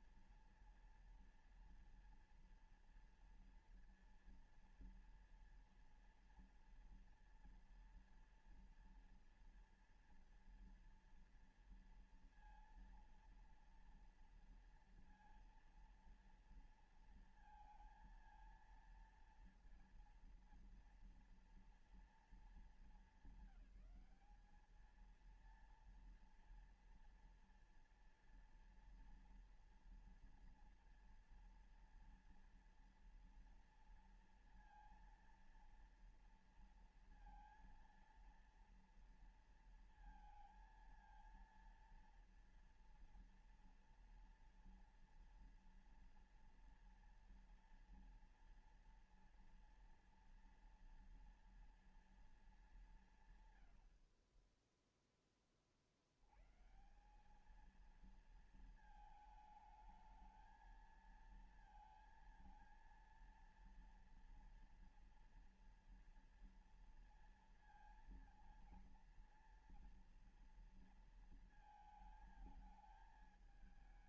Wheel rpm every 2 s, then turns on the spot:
230, 240, 230, 240, 230, 230, 230, 230, 230, 230, 230, 220, 210, 230, 240, 230, 230, 230, 230, 230, 230, 230, 230, 230, 230, 230, 220, 60, 90, 230, 220, 230, 230, 230, 230, 230, 220.
none